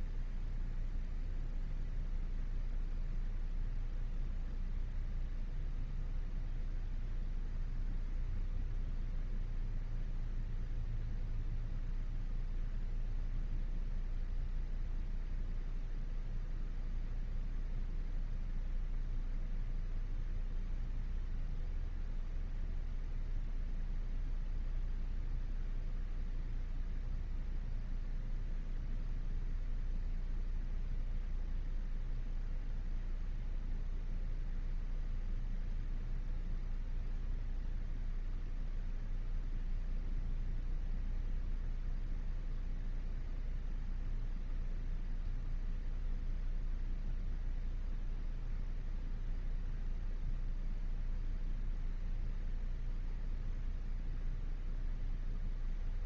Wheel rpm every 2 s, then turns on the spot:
0, 0, 0, 0, 0, 0, 0, 0, 0, 0, 0, 0, 0, 0, 0, 0, 0, 0, 0, 0, 0, 0, 0, 0, 0, 0, 0, 0.
none